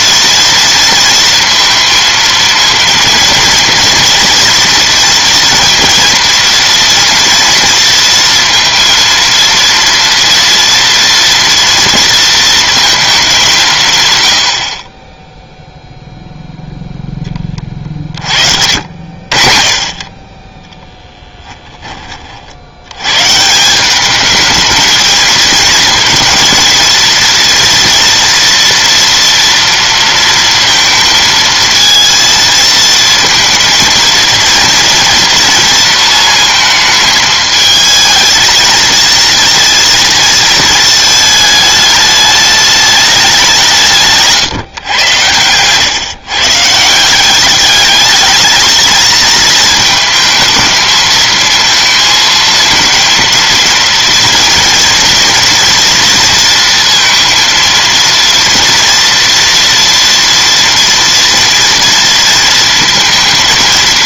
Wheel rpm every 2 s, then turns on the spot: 230, 230, 230, 230, 230, 230, 220, 30, 0, 70, 10, 90, 220, 220, 230, 230, 220, 230, 220, 220, 220, 210, 120, 170, 220, 220, 230, 230, 230, 230, 240, 230.
20-22